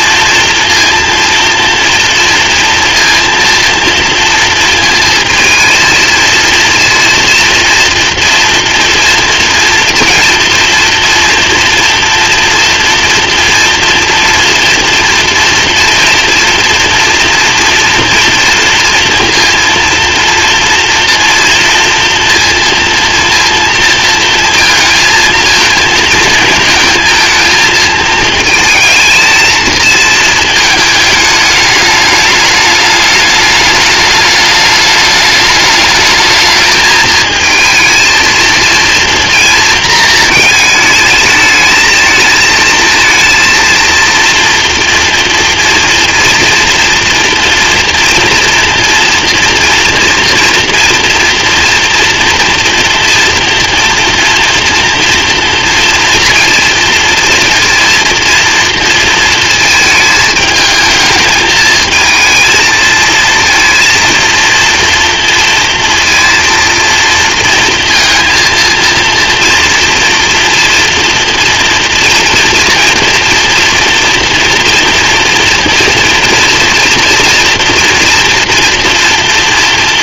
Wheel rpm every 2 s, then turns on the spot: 230, 230, 230, 230, 240, 230, 230, 230, 230, 230, 230, 230, 220, 220, 220, 220, 210, 210, 220, 230, 220, 220, 230, 230, 240, 230, 230, 230, 230, 230, 220, 220, 230, 230, 230, 240, 240, 240, 230, 230.
none